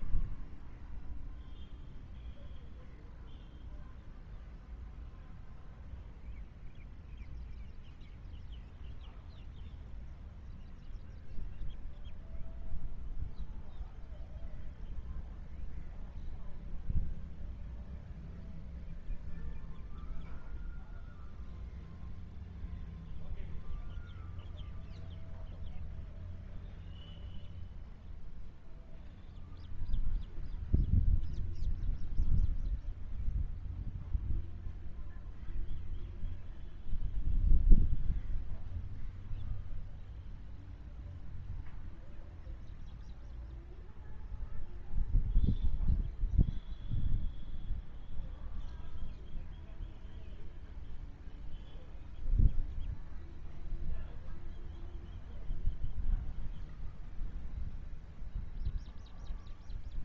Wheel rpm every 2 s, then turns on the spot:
0, 0, 0, 0, 0, 0, 0, 0, 0, 0, 0, 0, 0, 0, 0, 0, 0, 0, 0, 0, 0, 0, 0, 0, 0, 0, 0, 0, 0, 0.
none